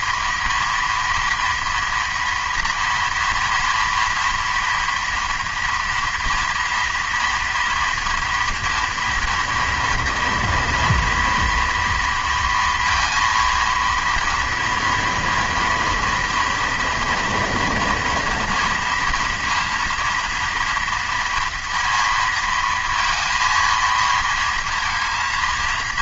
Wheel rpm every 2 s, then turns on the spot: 230, 230, 230, 230, 230, 230, 230, 240, 230, 230, 230, 230, 230.
none